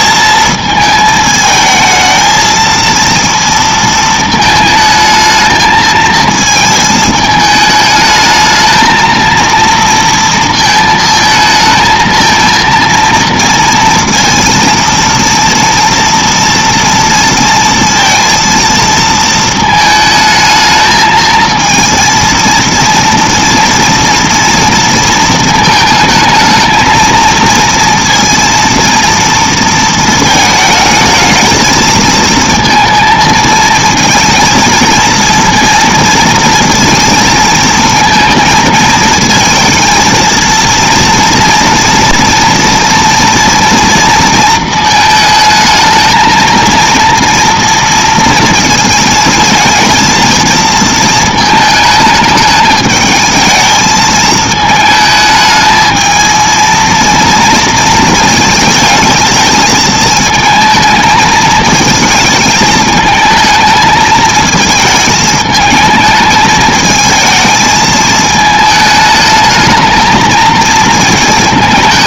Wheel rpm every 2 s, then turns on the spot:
220, 230, 220, 220, 230, 220, 230, 230, 230, 220, 230, 230, 220, 230, 220, 220, 220, 230, 220, 230, 240, 230, 220, 230, 230, 220, 220, 220, 230, 220, 220, 220, 220, 220, 220, 220.
none